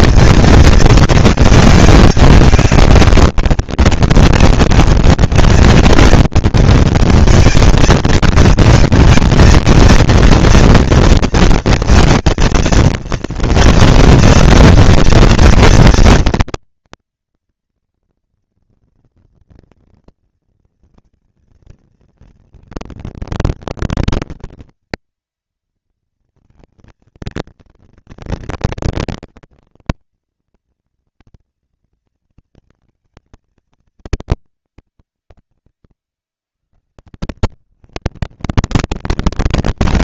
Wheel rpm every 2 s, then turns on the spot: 230, 200, 200, 210, 230, 230, 230, 230, 230, 230, 230, 230, 230, 230, 230, 240, 220, 180, 90, 180.
none